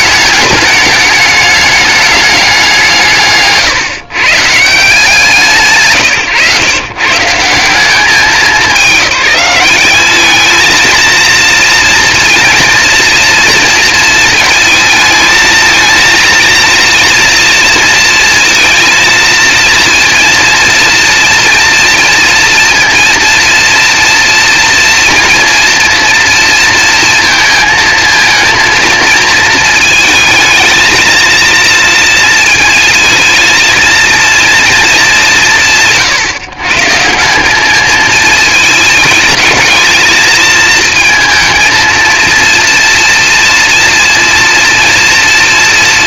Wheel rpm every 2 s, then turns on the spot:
210, 170, 130, 140, 190, 220, 230, 220, 230, 230, 230, 230, 230, 230, 230, 220, 230, 220, 150, 220, 220, 230, 230.
none